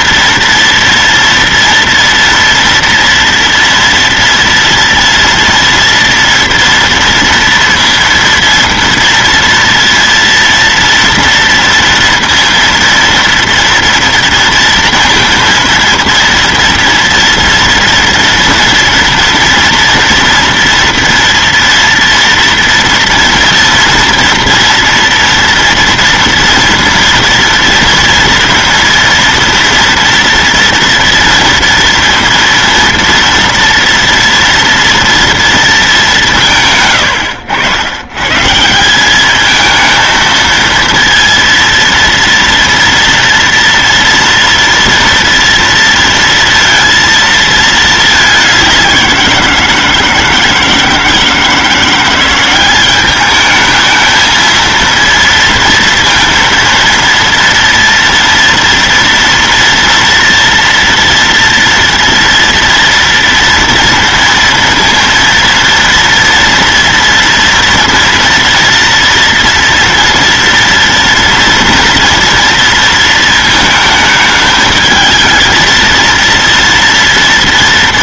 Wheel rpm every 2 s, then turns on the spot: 230, 230, 230, 230, 230, 230, 230, 230, 230, 230, 230, 230, 230, 230, 230, 230, 230, 230, 130, 170, 230, 230, 230, 230, 190, 160, 190, 230, 230, 230, 230, 230, 230, 230, 230, 230, 230, 220, 230.
none